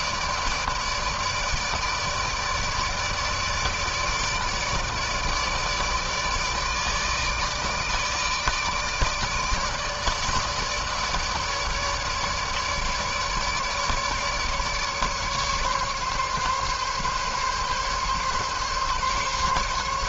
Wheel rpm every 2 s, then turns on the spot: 160, 160, 160, 160, 160, 150, 150, 150, 140, 140.
none